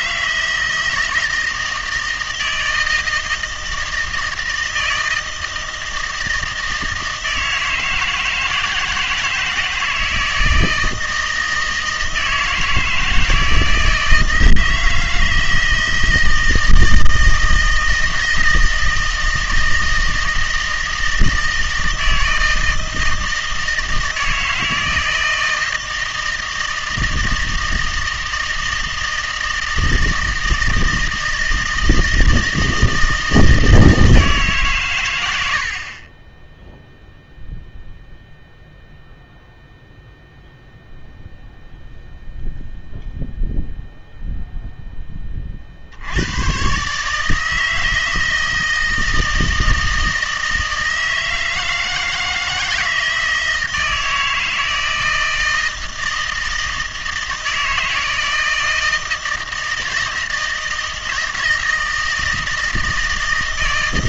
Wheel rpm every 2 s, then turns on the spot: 160, 160, 160, 160, 160, 160, 160, 160, 160, 160, 160, 160, 160, 160, 160, 160, 160, 150, 10, 0, 0, 0, 0, 130, 160, 160, 160, 160, 160, 160, 160, 160.
none